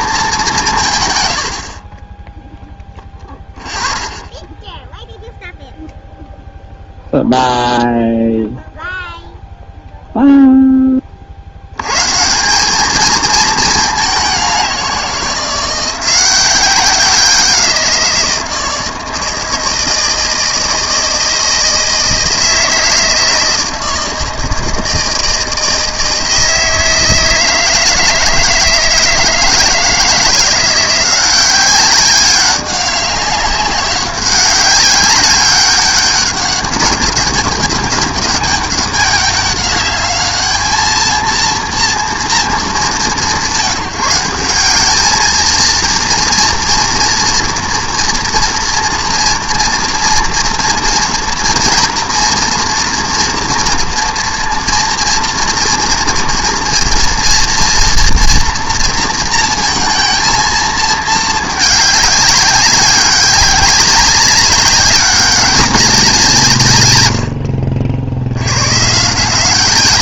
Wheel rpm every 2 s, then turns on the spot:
200, 0, 0, 0, 0, 0, 180, 190, 180, 170, 160, 160, 160, 160, 160, 170, 200, 190, 200, 200, 210, 200, 190, 230, 240, 230, 230, 240, 230, 230, 230, 190, 190, 140, 110.
none